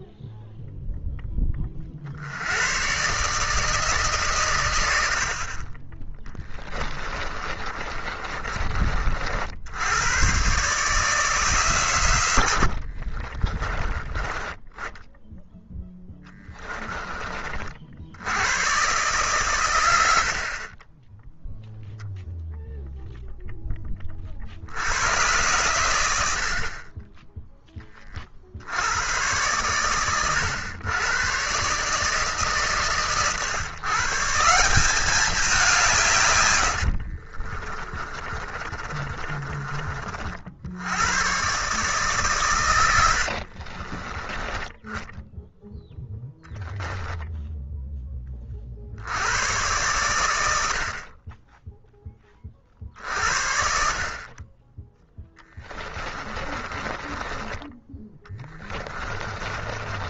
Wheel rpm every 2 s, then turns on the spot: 0, 120, 90, 20, 40, 140, 60, 10, 20, 130, 20, 0, 90, 30, 90, 100, 140, 190, 60, 30, 90, 100, 10, 0, 80, 50, 60, 10, 20, 20.
6-8 12-14 36-40 56-60